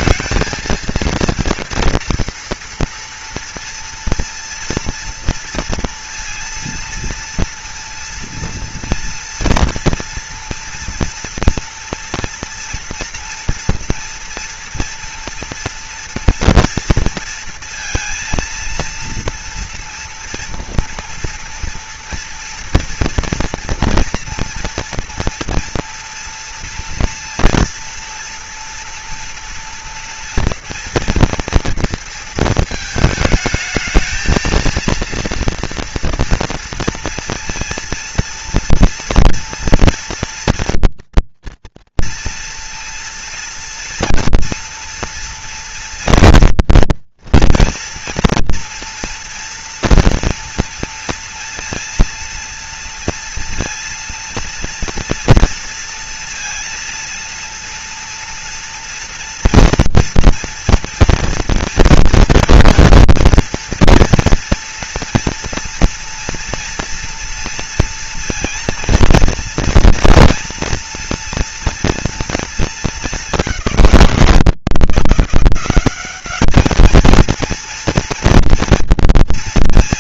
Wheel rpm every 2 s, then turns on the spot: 220, 230, 230, 230, 230, 240, 230, 230, 230, 230, 230, 230, 230, 230, 230, 230, 230, 220, 240, 230, 230, 230, 230, 230, 230, 240, 230, 230, 230, 230, 240, 230, 230, 230, 230, 230, 230, 170, 200, 230.
none